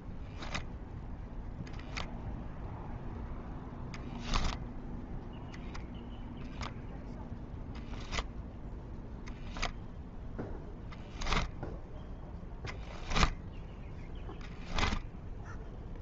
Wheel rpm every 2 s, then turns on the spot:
0, 0, 0, 0, 0, 10, 0, 0.
none